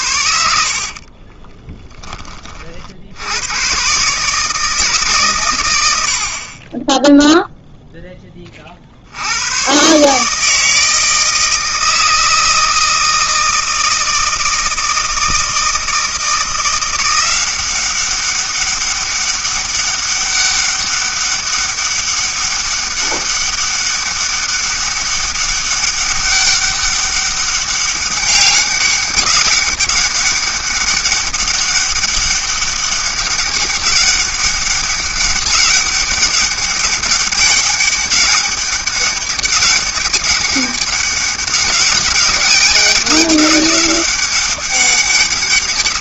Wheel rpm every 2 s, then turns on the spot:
50, 60, 150, 20, 60, 160, 160, 160, 170, 200, 200, 200, 190, 200, 200, 200, 200, 200, 200, 200, 200, 200, 200.
0-2